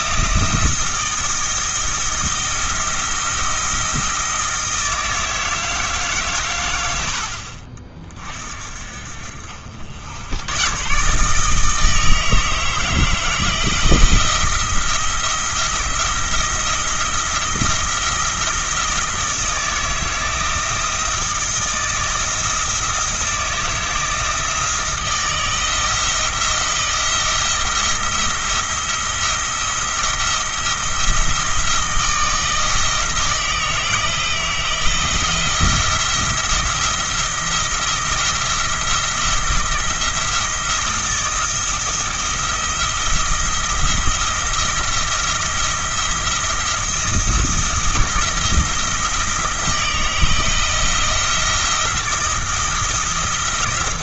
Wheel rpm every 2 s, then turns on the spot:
170, 170, 160, 90, 50, 120, 160, 170, 170, 170, 160, 160, 170, 170, 170, 170, 160, 160, 170, 170, 160, 170, 170, 170, 160, 170, 170.
none